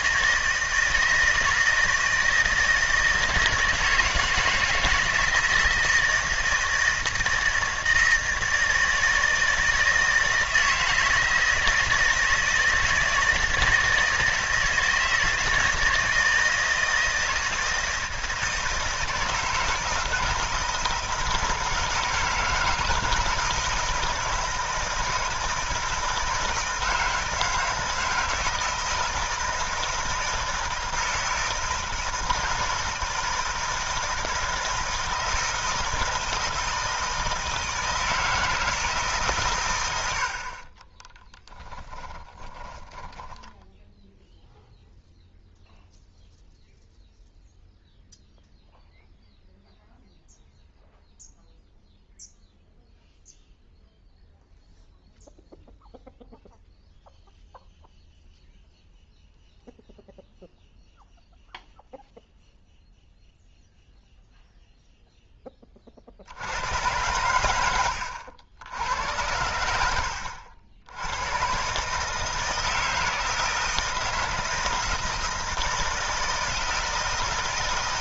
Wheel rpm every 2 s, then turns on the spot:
160, 160, 160, 160, 160, 160, 160, 160, 160, 160, 160, 160, 160, 160, 160, 160, 160, 160, 160, 160, 40, 10, 0, 0, 0, 0, 0, 0, 0, 0, 0, 0, 0, 100, 90, 80, 160, 160, 160.
40-44